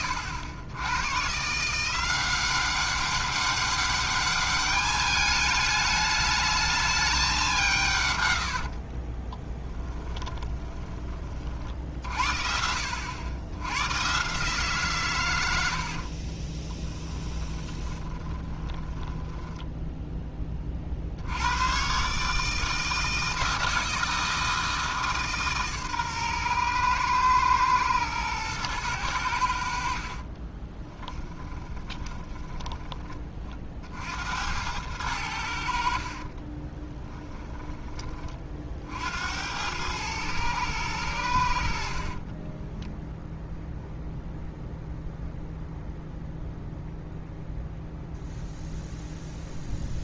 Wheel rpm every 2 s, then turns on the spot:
90, 190, 210, 210, 50, 30, 80, 140, 20, 20, 50, 160, 160, 120, 100, 10, 20, 90, 20, 60, 110, 10, 0, 0, 0.
8-10 16-20 30-32 36-38 42-44